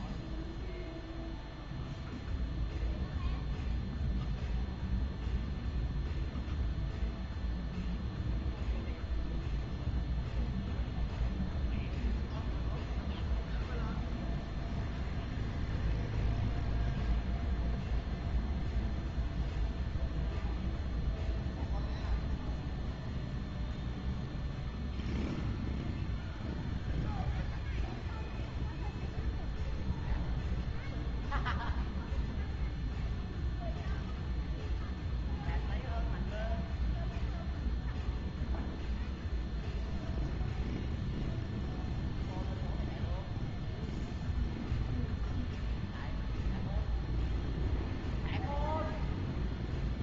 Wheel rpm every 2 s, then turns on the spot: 0, 0, 0, 0, 0, 0, 0, 0, 0, 0, 0, 0, 0, 0, 0, 0, 0, 0, 0, 0, 0, 0, 0, 0, 0.
none